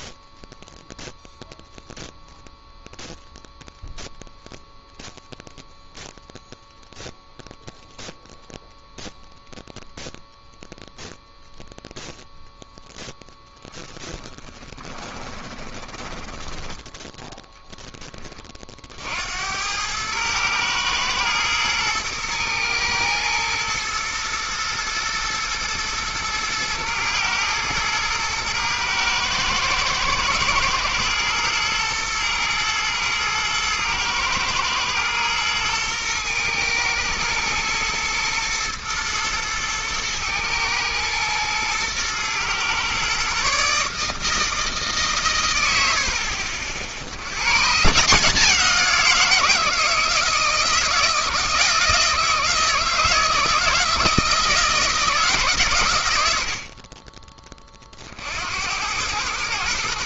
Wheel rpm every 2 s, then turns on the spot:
0, 0, 0, 0, 0, 0, 0, 20, 20, 30, 110, 120, 110, 110, 110, 110, 120, 120, 110, 110, 110, 120, 150, 50, 170, 160, 160, 160, 60, 80.
14-18